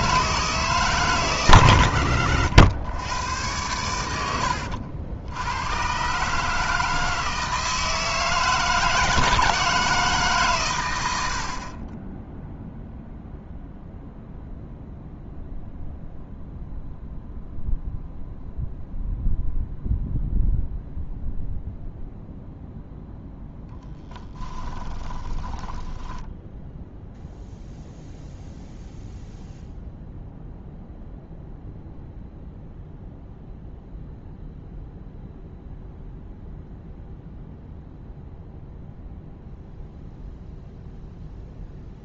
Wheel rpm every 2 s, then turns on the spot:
150, 100, 80, 160, 160, 120, 0, 0, 0, 0, 0, 0, 20, 0, 0, 0, 0, 0, 0, 0, 0.
24-26